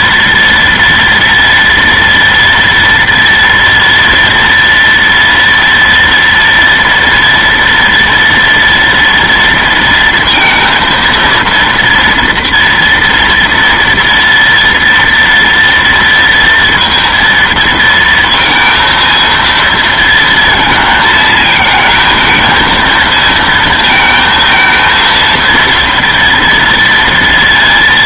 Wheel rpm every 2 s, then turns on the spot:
230, 230, 230, 230, 230, 230, 230, 230, 230, 230, 230, 220, 230, 230.
none